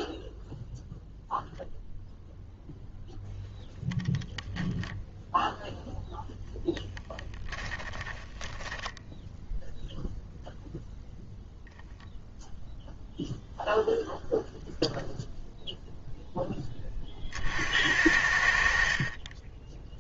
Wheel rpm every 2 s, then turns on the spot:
0, 0, 0, 0, 10, 0, 0, 0, 10, 50.
8-10